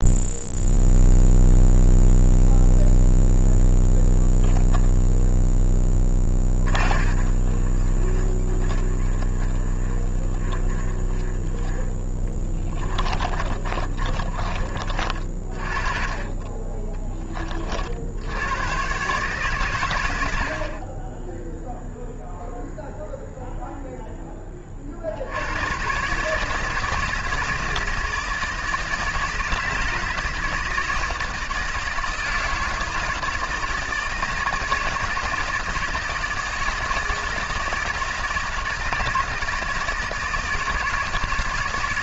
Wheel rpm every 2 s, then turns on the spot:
0, 0, 10, 30, 30, 30, 20, 30, 20, 100, 30, 0, 30, 160, 160, 160, 160, 160, 160, 160, 160.
6-14